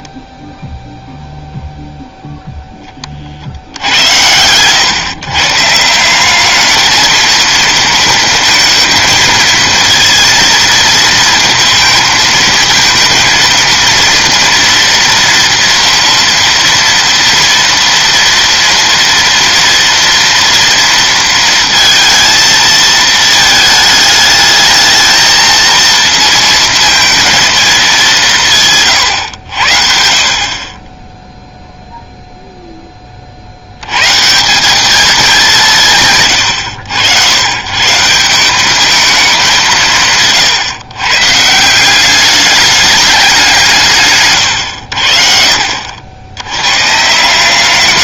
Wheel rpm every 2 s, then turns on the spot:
0, 10, 120, 220, 230, 230, 230, 230, 230, 240, 230, 220, 220, 230, 140, 30, 10, 190, 100, 200, 140, 210, 100, 110.
none